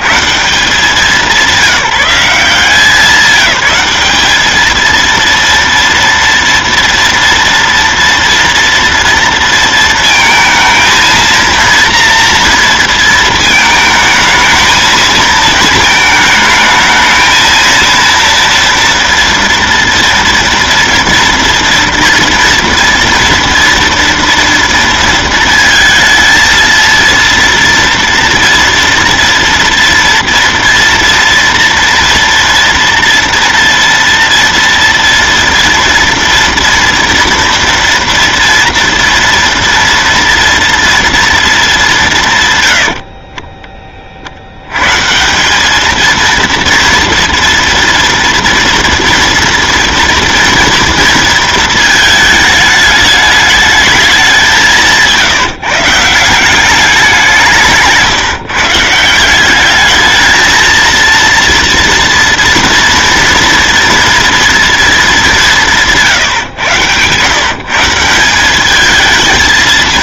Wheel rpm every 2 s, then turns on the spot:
130, 180, 210, 230, 230, 230, 230, 220, 220, 230, 230, 230, 230, 230, 230, 230, 230, 230, 230, 230, 230, 180, 50, 230, 230, 230, 220, 190, 160, 150, 220, 240, 230, 160, 180.
66-68